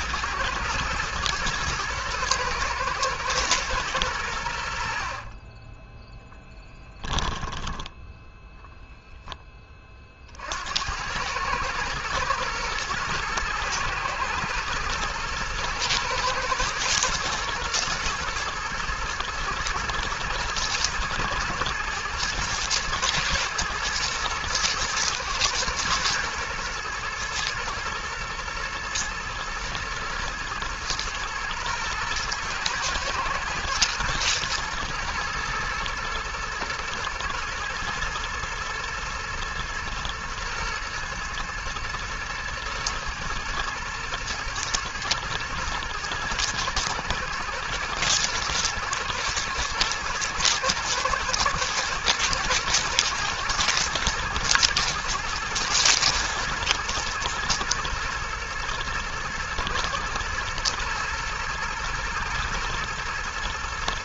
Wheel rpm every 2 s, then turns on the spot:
110, 110, 10, 10, 30, 110, 110, 110, 110, 110, 110, 110, 110, 110, 120, 110, 120, 110, 120, 120, 110, 110, 110, 120, 110, 120, 120, 120, 120, 120, 120, 110.
4-6